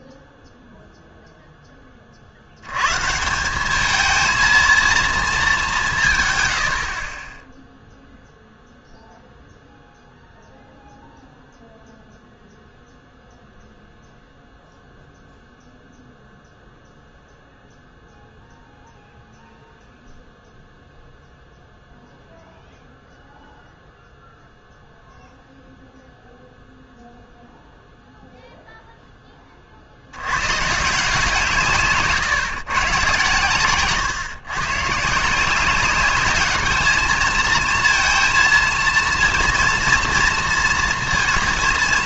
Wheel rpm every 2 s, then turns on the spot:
0, 100, 230, 80, 0, 0, 0, 0, 0, 0, 0, 0, 0, 0, 0, 150, 130, 140, 210, 230, 230.
none